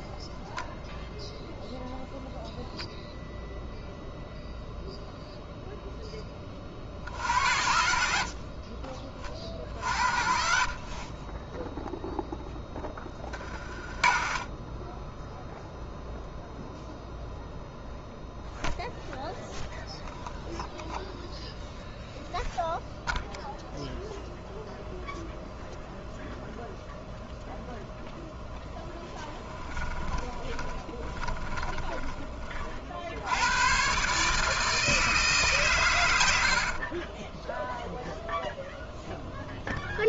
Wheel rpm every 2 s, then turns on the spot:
0, 0, 0, 40, 40, 40, 10, 20, 0, 0, 0, 0, 0, 0, 10, 20, 40, 160, 60, 0.
28-32 36-38